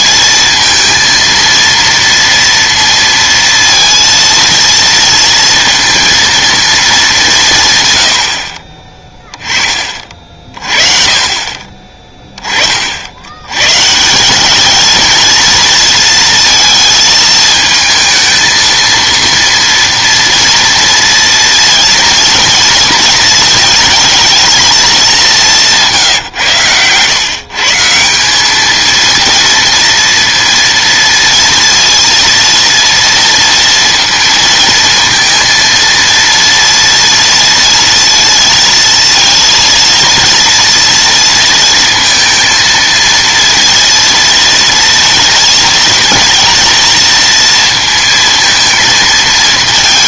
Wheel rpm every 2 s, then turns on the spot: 230, 230, 230, 220, 30, 40, 30, 210, 220, 230, 230, 230, 220, 120, 220, 230, 230, 230, 230, 230, 230, 230, 230, 230, 220.
none